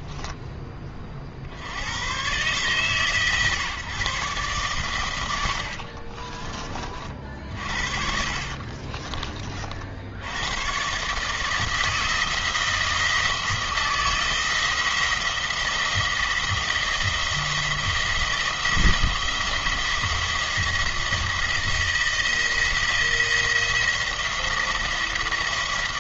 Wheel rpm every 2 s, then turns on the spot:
20, 140, 130, 30, 40, 110, 160, 170, 170, 160, 170, 160, 170.
8-10